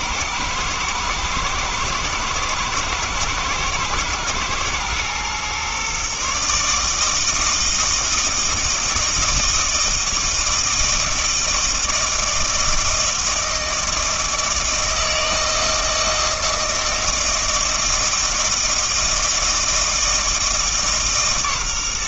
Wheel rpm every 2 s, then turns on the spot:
110, 110, 110, 150, 160, 160, 160, 160, 160, 160, 150.
none